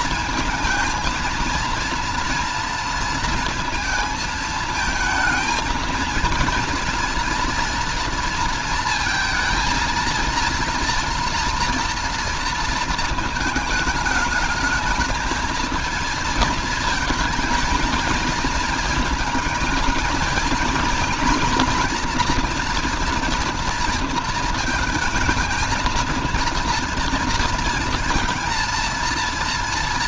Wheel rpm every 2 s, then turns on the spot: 220, 230, 230, 230, 230, 230, 230, 210, 230, 220, 230, 240, 230, 230, 230.
none